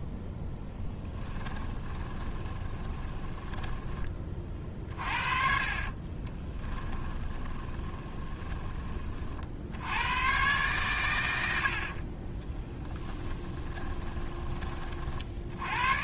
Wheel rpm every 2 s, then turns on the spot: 10, 20, 40, 10, 30, 120, 10, 30.
2-4 6-8 12-14